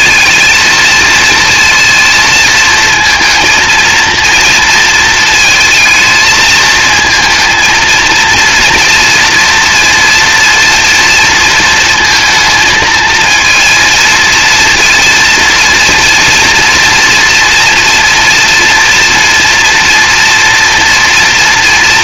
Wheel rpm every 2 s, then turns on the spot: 230, 230, 230, 220, 230, 230, 220, 230, 230, 230, 230.
none